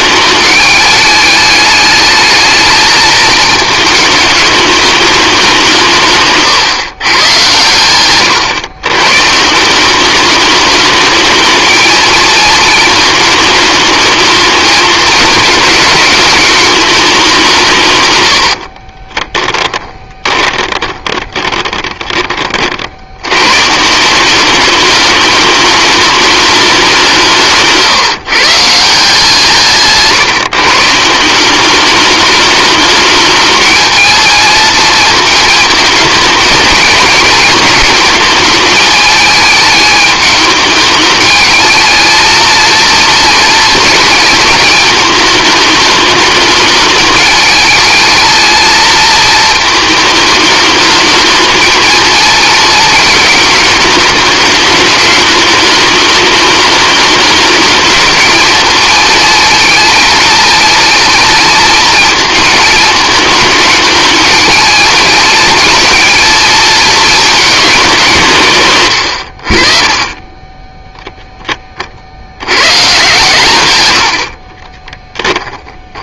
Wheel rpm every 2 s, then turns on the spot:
210, 220, 210, 130, 120, 210, 220, 220, 210, 50, 20, 70, 210, 190, 160, 150, 210, 220, 220, 220, 210, 230, 220, 220, 230, 220, 220, 210, 210, 230, 230, 220, 220, 220, 110, 10, 130, 10.
18-22 68-70 74-76